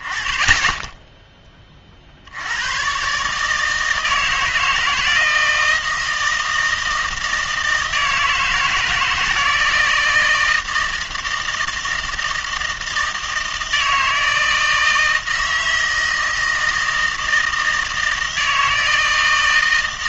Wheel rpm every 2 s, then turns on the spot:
10, 110, 170, 160, 160, 160, 160, 160, 160, 160.
none